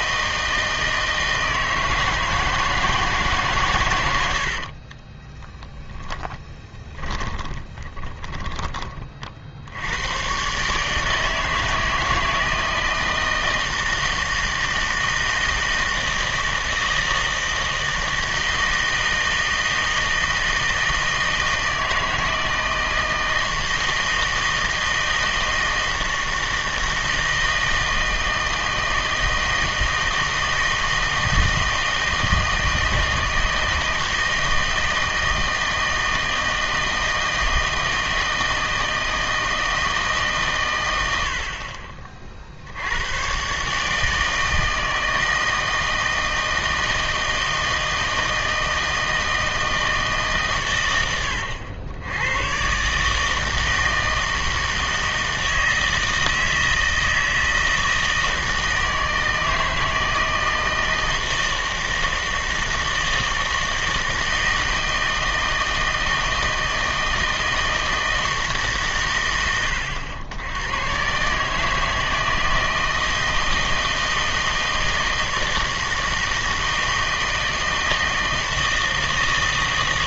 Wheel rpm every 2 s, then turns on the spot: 160, 160, 30, 20, 30, 150, 160, 160, 160, 160, 160, 160, 160, 160, 160, 160, 160, 160, 160, 160, 100, 90, 160, 160, 160, 110, 140, 160, 160, 160, 160, 160, 160, 160, 130, 130, 160, 160, 160, 160.
4-8